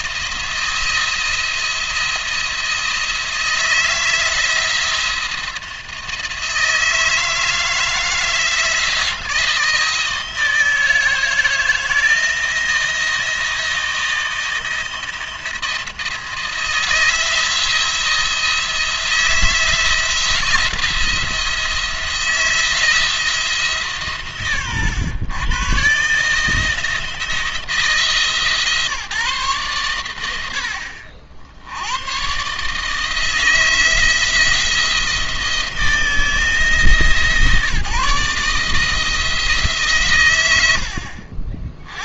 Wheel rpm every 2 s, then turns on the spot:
170, 170, 170, 160, 170, 160, 170, 170, 160, 170, 170, 160, 120, 160, 150, 70, 140, 160, 150, 150, 90.
none